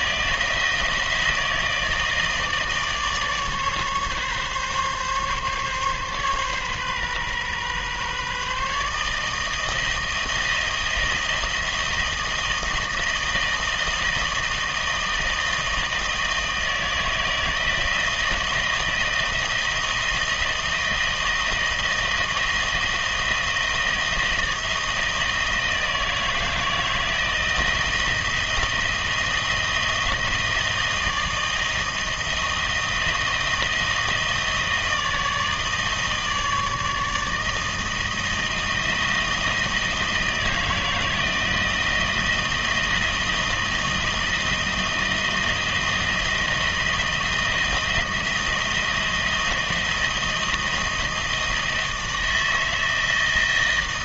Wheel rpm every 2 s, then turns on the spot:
160, 150, 140, 130, 150, 170, 160, 160, 160, 160, 160, 160, 160, 160, 160, 160, 160, 160, 160, 160, 160, 160, 160, 170, 170, 160, 160.
none